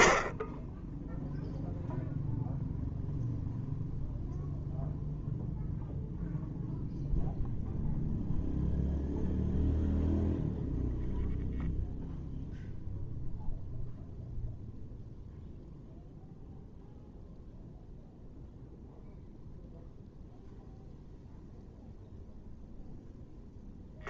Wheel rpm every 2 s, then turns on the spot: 10, 0, 0, 0, 0, 0, 0, 0, 0, 0, 0, 0.
none